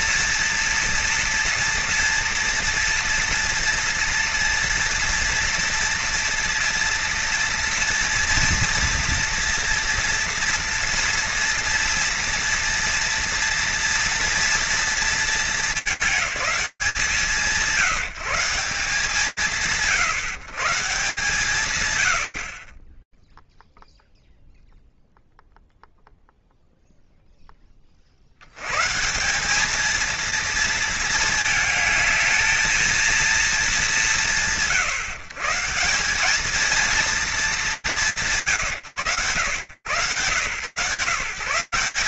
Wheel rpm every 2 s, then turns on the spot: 230, 230, 230, 230, 230, 230, 230, 230, 190, 160, 150, 50, 0, 0, 150, 220, 220, 130, 220, 90, 140.
none